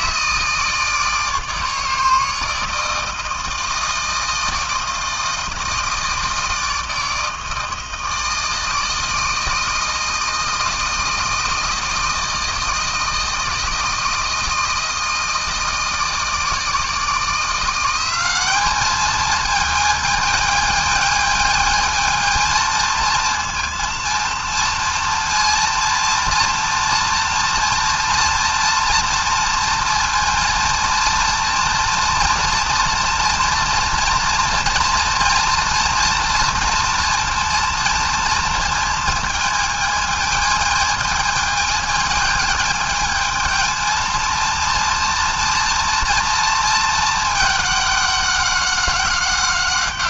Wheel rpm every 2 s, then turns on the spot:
160, 160, 160, 160, 160, 160, 160, 160, 160, 200, 220, 220, 230, 230, 230, 230, 230, 230, 230, 230, 220, 220, 230, 230, 200.
none